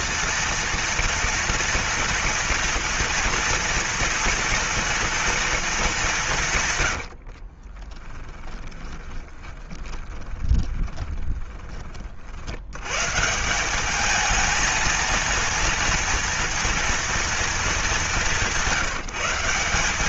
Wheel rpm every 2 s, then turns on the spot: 230, 230, 230, 120, 10, 20, 110, 230, 230, 180.
6-12